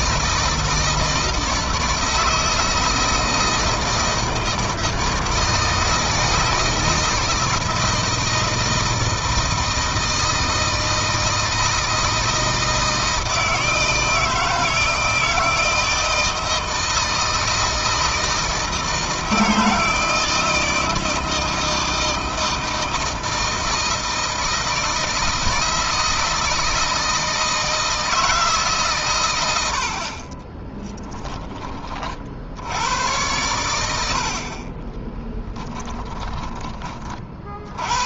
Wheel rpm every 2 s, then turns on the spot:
160, 160, 160, 160, 160, 160, 160, 160, 160, 160, 160, 160, 160, 160, 140, 20, 80, 40, 30.
30-32 34-36